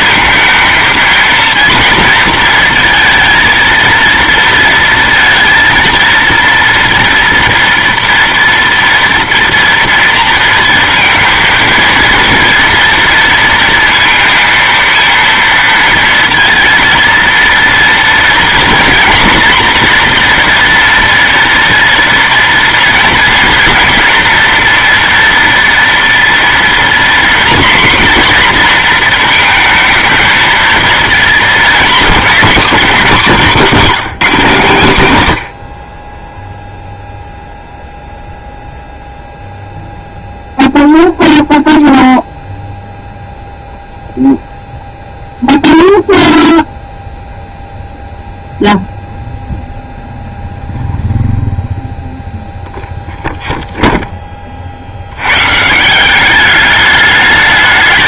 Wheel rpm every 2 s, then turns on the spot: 230, 230, 230, 230, 230, 230, 230, 230, 230, 230, 240, 230, 230, 240, 240, 230, 210, 180, 0, 0, 0, 0, 0, 0, 0, 0, 0, 40, 200.
none